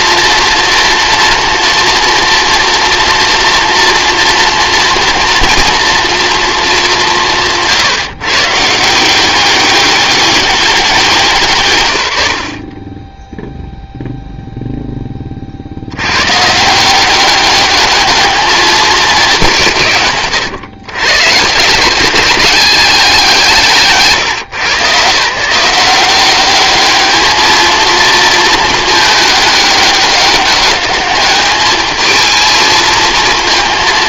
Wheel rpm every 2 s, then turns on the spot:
230, 240, 230, 220, 150, 190, 40, 0, 150, 220, 120, 190, 120, 210, 220, 200, 220.
none